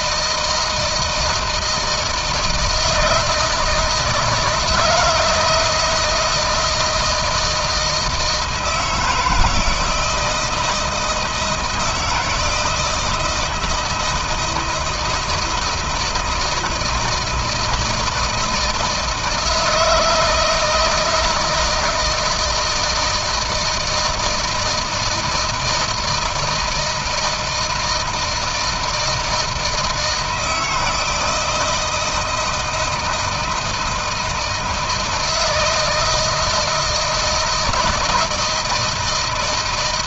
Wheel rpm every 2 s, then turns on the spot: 160, 160, 160, 170, 160, 160, 160, 160, 160, 160, 160, 160, 160, 160, 160, 160, 160, 160, 160, 160.
none